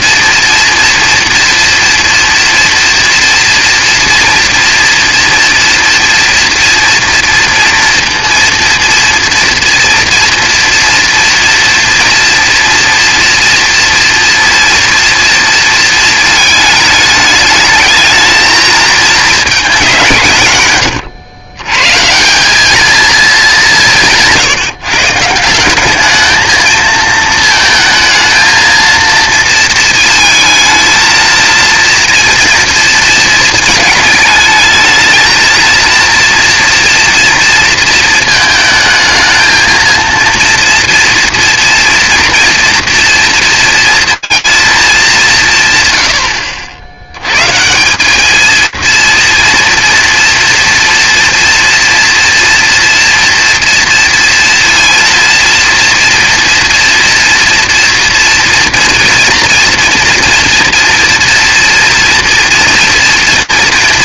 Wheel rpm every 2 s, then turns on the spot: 230, 230, 230, 230, 230, 230, 230, 230, 220, 220, 120, 210, 150, 220, 230, 230, 230, 220, 230, 220, 230, 230, 220, 90, 230, 240, 230, 230, 230, 230, 230, 240.
none